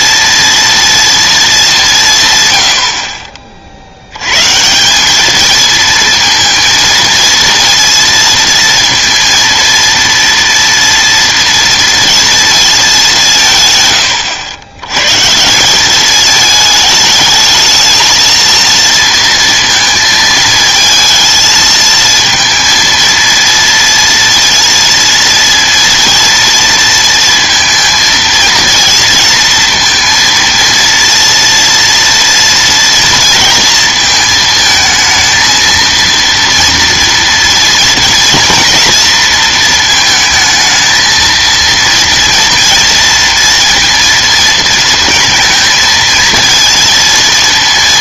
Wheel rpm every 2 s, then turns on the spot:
230, 90, 150, 230, 230, 230, 220, 100, 220, 230, 220, 230, 240, 230, 230, 230, 230, 220, 230, 240, 220, 230, 230, 230.
none